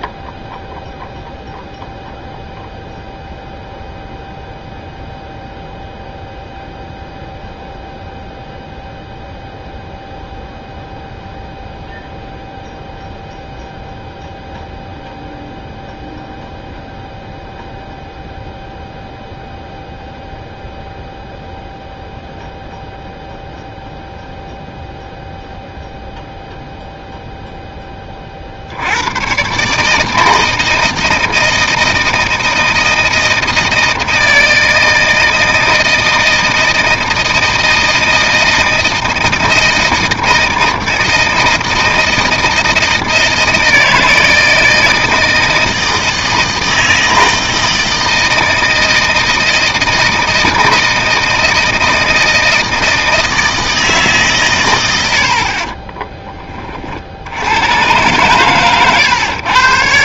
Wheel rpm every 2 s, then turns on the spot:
0, 0, 0, 0, 0, 0, 0, 0, 0, 0, 0, 0, 0, 10, 140, 160, 160, 160, 160, 160, 160, 160, 160, 160, 160, 160, 160, 30, 100, 120.
none